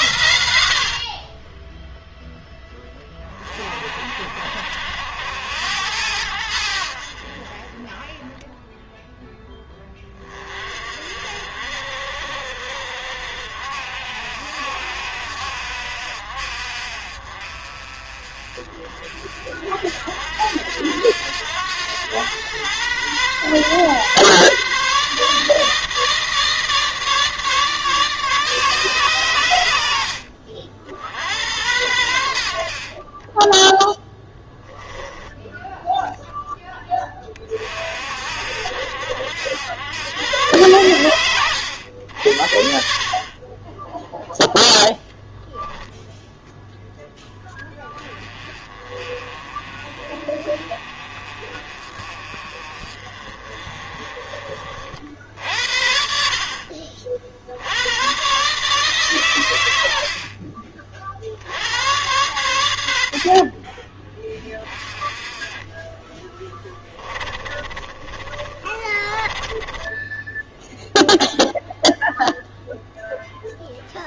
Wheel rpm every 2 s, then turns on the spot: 70, 10, 50, 80, 10, 40, 60, 60, 50, 40, 80, 110, 140, 160, 140, 60, 70, 10, 10, 70, 110, 60, 0, 0, 30, 30, 40, 50, 50, 130, 50, 90, 20, 20, 30, 0, 0.
66-70